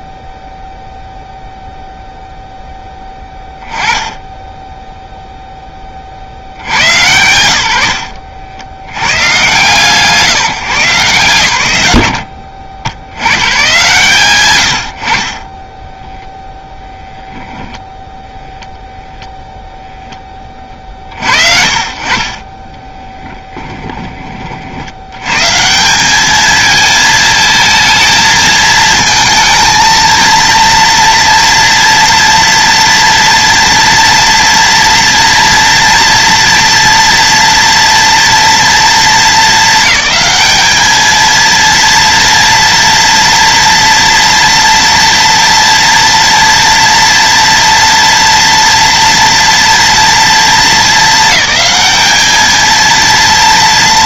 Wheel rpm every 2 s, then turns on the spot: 0, 10, 0, 110, 80, 130, 60, 50, 0, 0, 50, 10, 90, 220, 220, 230, 230, 230, 230, 220, 210, 230, 230, 230, 230, 210, 230.
22-24